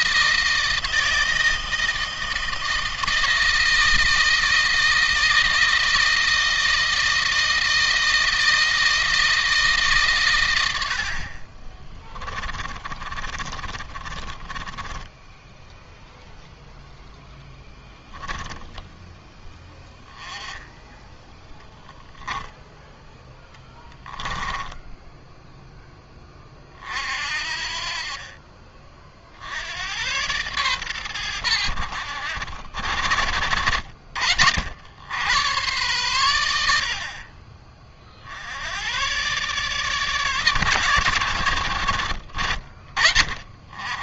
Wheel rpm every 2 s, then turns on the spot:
160, 160, 160, 160, 160, 80, 30, 20, 0, 0, 10, 0, 10, 40, 40, 120, 70, 80, 80, 90, 120, 40.
12-16 24-26